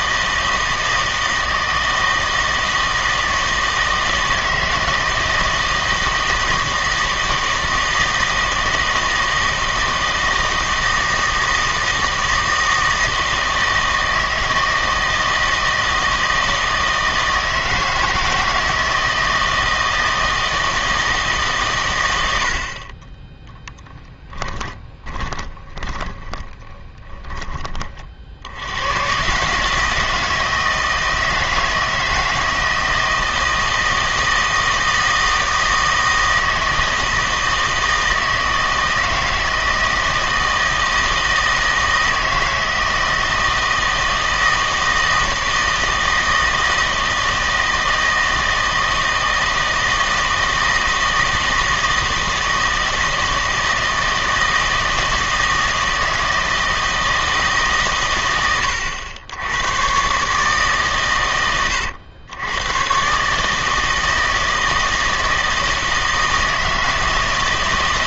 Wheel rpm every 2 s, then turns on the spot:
160, 160, 160, 160, 160, 160, 160, 160, 160, 160, 160, 40, 10, 20, 90, 160, 160, 160, 160, 160, 160, 160, 160, 160, 160, 160, 160, 160, 160, 90, 140, 120, 160, 160.
24-28